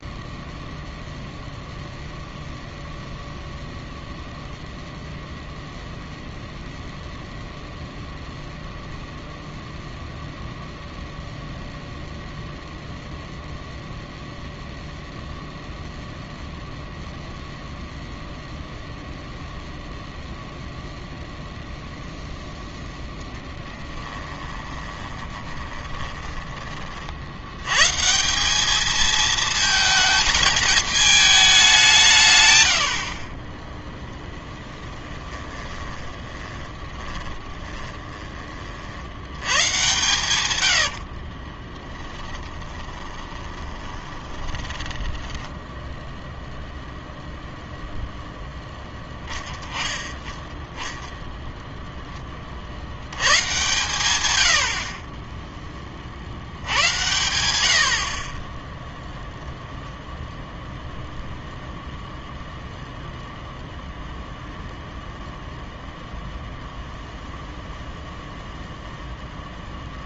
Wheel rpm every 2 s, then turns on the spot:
0, 0, 0, 0, 0, 0, 0, 0, 0, 0, 0, 10, 20, 30, 210, 210, 80, 10, 20, 50, 80, 20, 20, 0, 10, 10, 70, 80, 90, 0, 0, 0, 0, 0, 0.
24-26 34-38 40-46